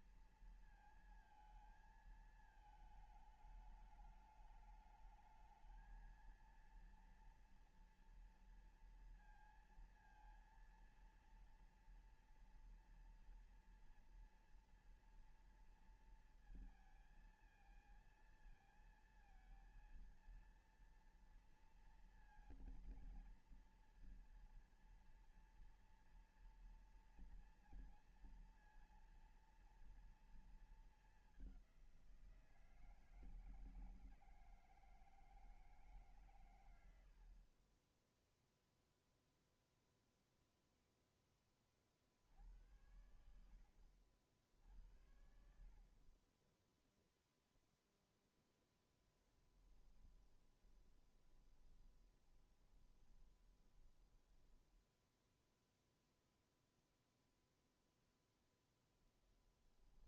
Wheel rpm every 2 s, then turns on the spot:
230, 220, 210, 230, 230, 230, 230, 230, 230, 230, 230, 230, 230, 230, 230, 230, 170, 160, 140, 10, 0, 50, 70, 50, 0, 10, 20, 10, 0, 0.
38-40 50-56